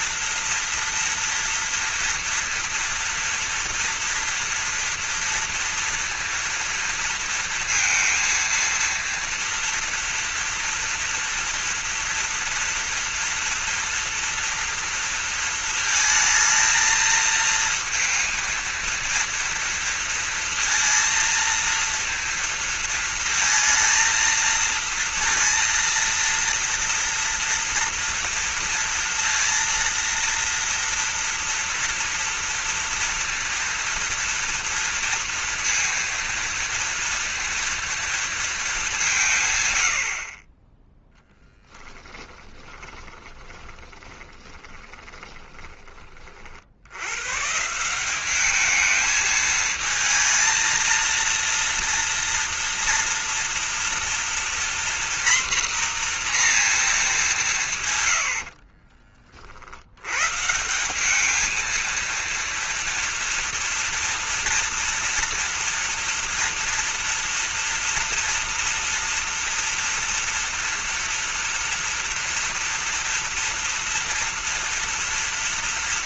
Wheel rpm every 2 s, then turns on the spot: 230, 240, 230, 230, 230, 230, 230, 230, 220, 230, 230, 230, 220, 230, 230, 230, 230, 230, 230, 220, 20, 20, 20, 70, 210, 230, 230, 240, 230, 40, 170, 230, 230, 230, 240, 230, 230, 240.
42-46 58-60